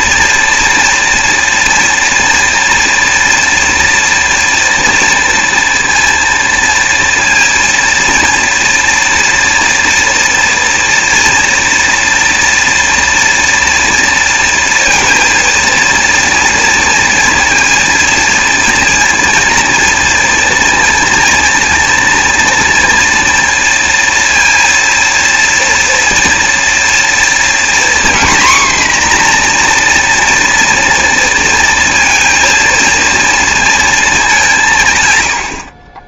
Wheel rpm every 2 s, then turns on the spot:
230, 240, 230, 230, 230, 230, 230, 230, 230, 230, 230, 230, 230, 230, 250, 240, 230, 160.
none